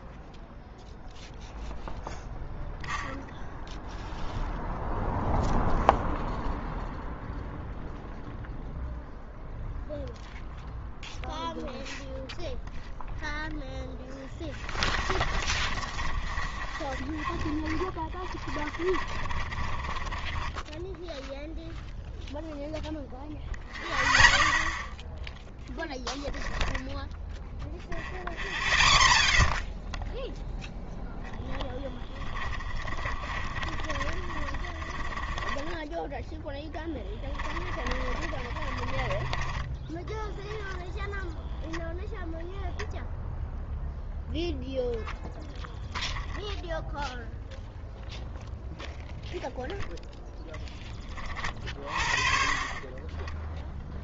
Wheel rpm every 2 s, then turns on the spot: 0, 0, 0, 0, 0, 0, 0, 20, 20, 30, 10, 0, 0, 0, 0, 0, 30, 20, 10, 30, 10, 0, 0, 0, 0, 10, 30.
14-22 32-36 38-42